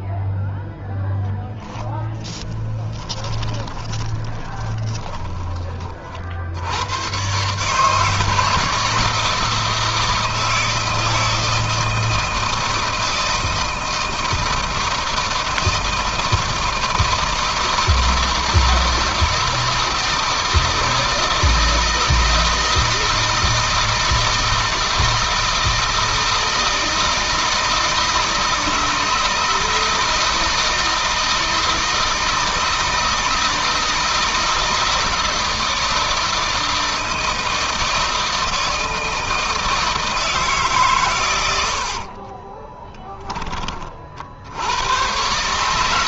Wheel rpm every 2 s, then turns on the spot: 0, 20, 20, 100, 160, 160, 160, 160, 160, 160, 160, 160, 160, 160, 160, 160, 160, 160, 160, 160, 130, 20, 100.
2-6 42-44